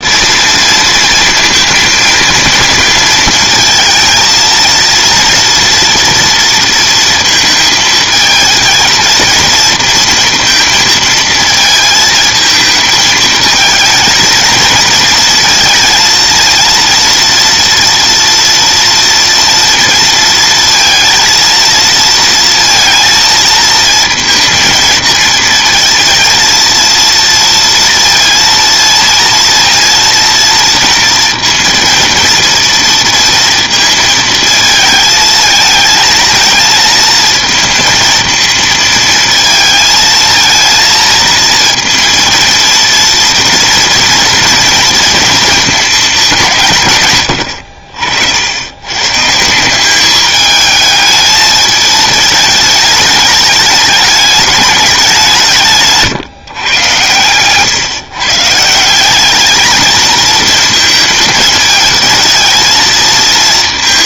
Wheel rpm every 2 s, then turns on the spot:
220, 230, 230, 230, 220, 230, 220, 230, 230, 230, 230, 230, 220, 230, 230, 230, 230, 220, 220, 230, 230, 230, 230, 140, 110, 220, 210, 200, 130, 170, 230, 220.
none